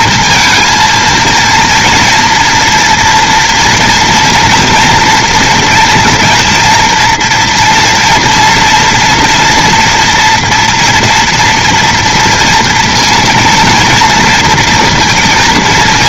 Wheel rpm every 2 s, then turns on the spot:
230, 230, 240, 230, 230, 230, 230, 230.
none